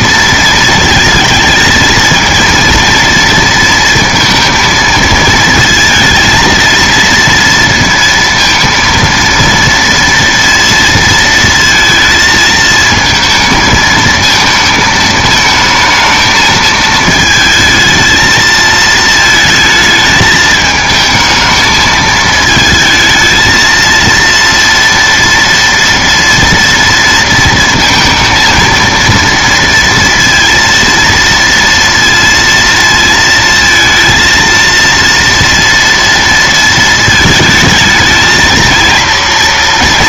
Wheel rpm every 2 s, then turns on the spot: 230, 230, 230, 230, 230, 230, 220, 220, 220, 220, 220, 220, 230, 240, 230, 230, 230, 230, 230, 220.
none